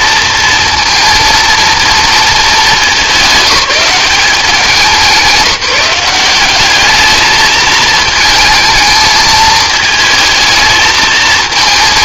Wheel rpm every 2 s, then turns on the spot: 230, 200, 190, 190, 220, 220.
none